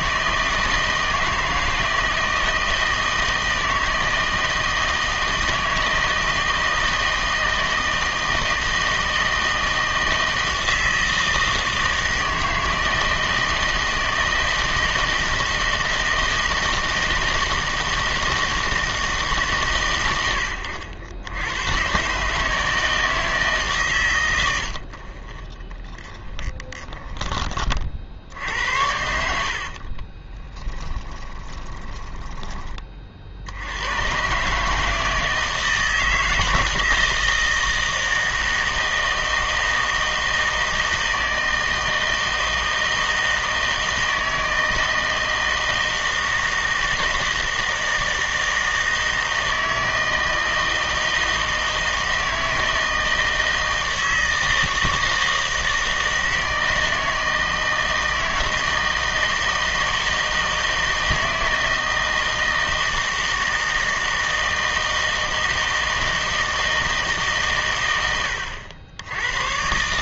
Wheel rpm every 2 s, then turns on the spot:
160, 160, 160, 160, 160, 160, 160, 160, 160, 160, 100, 160, 70, 10, 70, 20, 20, 150, 160, 160, 160, 160, 160, 160, 160, 160, 160, 160, 160, 160, 160, 160, 160, 160, 90.
26-28 30-32